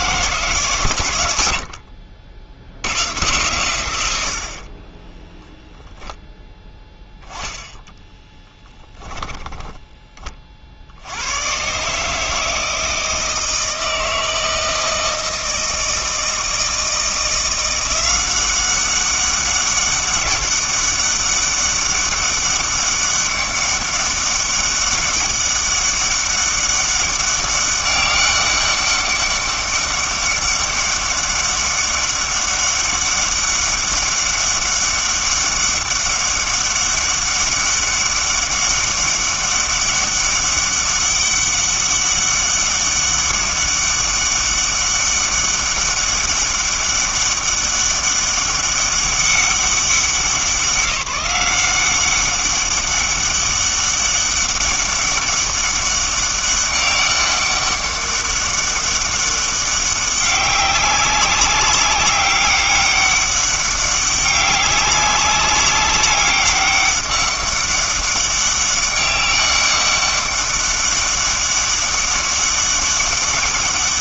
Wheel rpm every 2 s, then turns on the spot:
140, 90, 40, 0, 10, 60, 160, 160, 160, 190, 200, 200, 200, 200, 200, 200, 200, 200, 200, 200, 200, 200, 200, 200, 200, 190, 200, 200, 200, 200, 190, 200, 200, 200, 200, 200, 200.
4-6 8-10